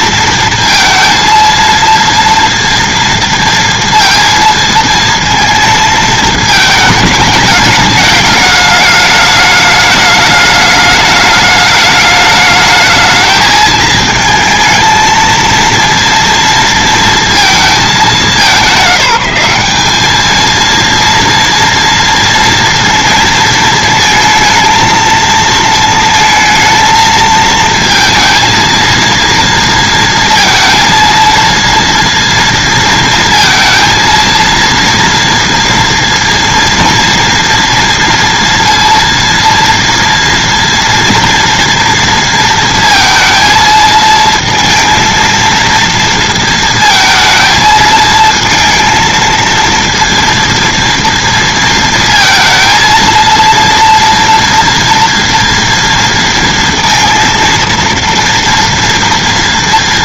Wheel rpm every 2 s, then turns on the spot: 230, 230, 230, 220, 210, 210, 220, 220, 230, 190, 230, 230, 230, 220, 230, 230, 230, 230, 230, 230, 230, 230, 230, 230, 230, 230, 230, 230, 230, 230.
none